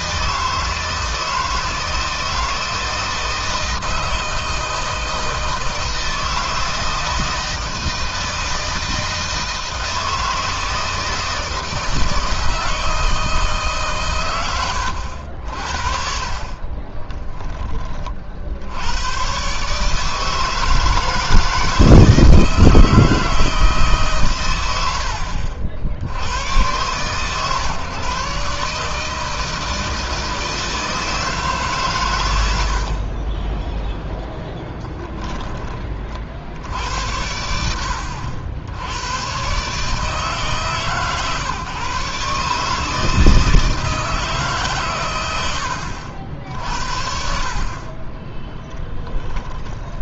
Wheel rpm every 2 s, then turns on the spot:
160, 160, 160, 160, 160, 160, 160, 90, 30, 100, 160, 160, 100, 120, 150, 160, 40, 10, 80, 90, 140, 150, 120, 60, 10.
16-18 48-50